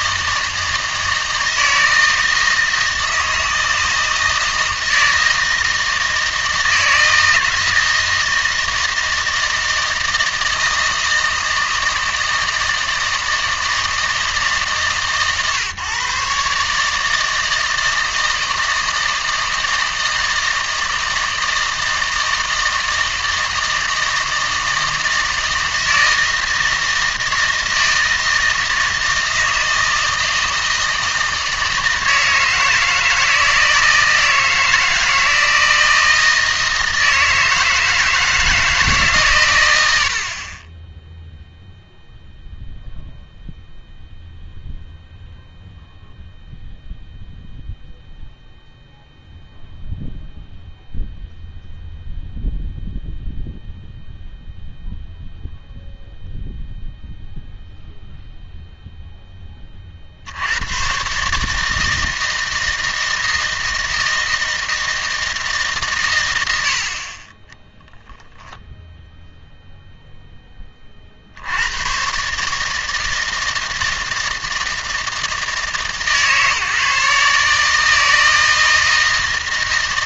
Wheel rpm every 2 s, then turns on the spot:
160, 160, 160, 160, 160, 160, 160, 140, 150, 160, 160, 160, 160, 160, 160, 160, 160, 160, 160, 160, 30, 0, 0, 0, 0, 0, 0, 0, 0, 0, 110, 160, 160, 80, 0, 20, 150, 160, 150, 160.
none